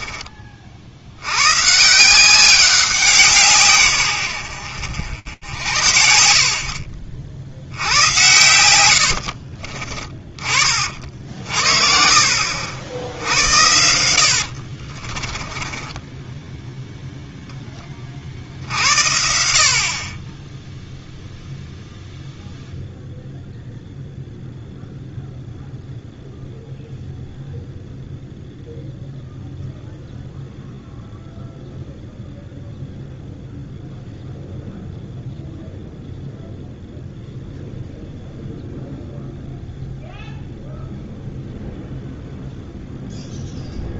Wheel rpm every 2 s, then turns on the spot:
50, 190, 90, 70, 100, 50, 60, 50, 10, 60, 0, 0, 0, 0, 0, 0, 0, 0, 0, 0, 0, 0.
14-16